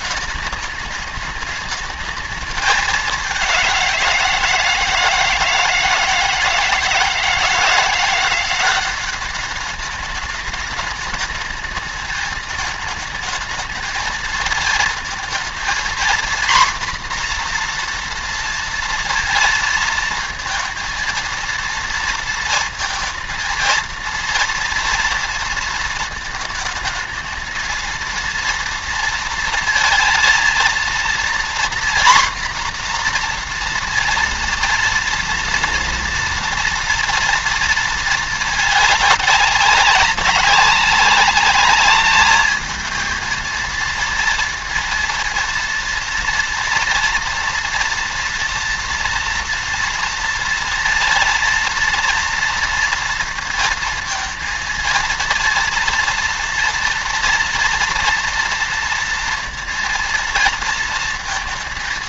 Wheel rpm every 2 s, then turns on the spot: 210, 210, 160, 160, 180, 210, 220, 220, 240, 230, 230, 230, 230, 220, 230, 230, 250, 230, 230, 220, 200, 220, 230, 230, 230, 230, 230, 230, 230, 230, 230.
none